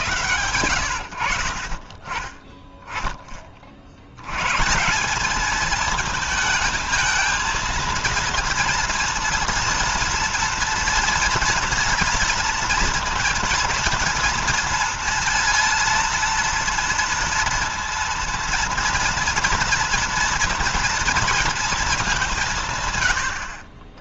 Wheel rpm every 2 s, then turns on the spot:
90, 10, 140, 220, 230, 230, 230, 230, 230, 230, 230, 160.
none